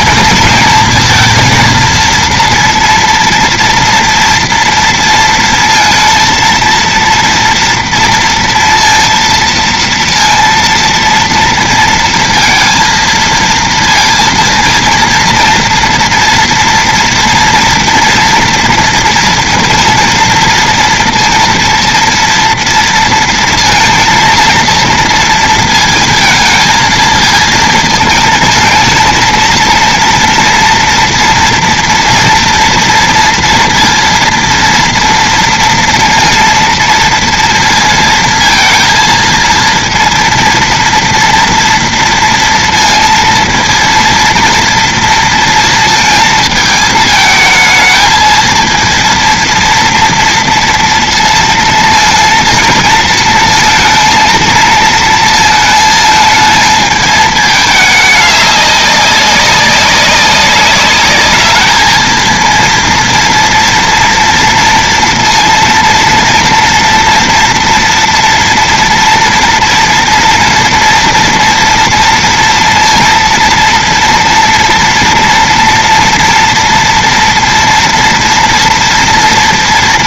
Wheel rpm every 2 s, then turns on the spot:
230, 230, 230, 230, 230, 230, 230, 230, 230, 230, 230, 230, 230, 230, 220, 230, 230, 230, 230, 230, 230, 230, 230, 220, 220, 230, 230, 230, 220, 200, 190, 230, 230, 230, 230, 240, 230, 240, 230, 230.
none